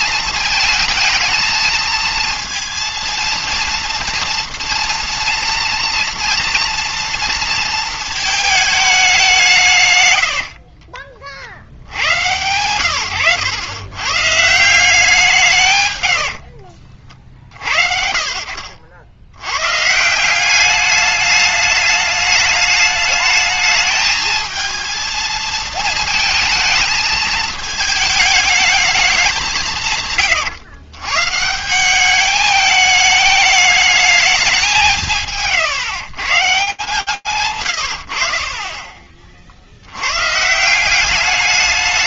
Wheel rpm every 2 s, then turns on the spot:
220, 230, 230, 230, 220, 70, 100, 160, 50, 60, 200, 210, 220, 220, 210, 120, 210, 200, 130, 30, 190.
10-12 16-18